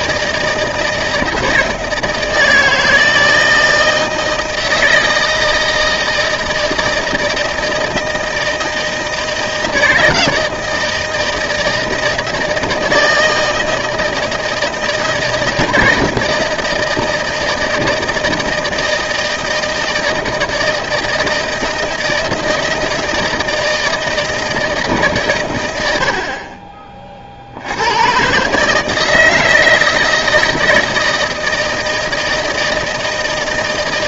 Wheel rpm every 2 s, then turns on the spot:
160, 160, 160, 160, 160, 160, 160, 160, 160, 160, 170, 160, 160, 40, 150, 160, 160.
none